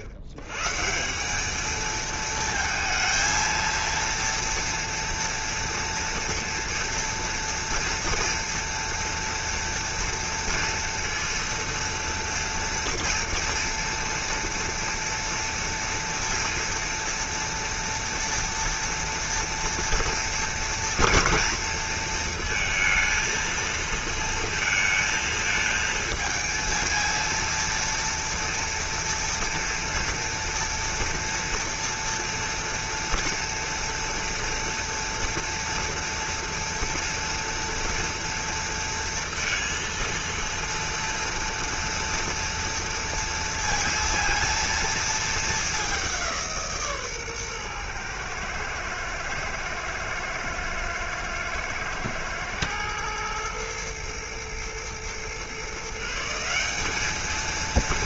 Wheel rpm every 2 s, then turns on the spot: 110, 220, 240, 230, 230, 230, 240, 230, 230, 230, 230, 230, 230, 230, 230, 230, 230, 230, 230, 230, 230, 230, 230, 160, 110, 110, 110, 120, 190.
none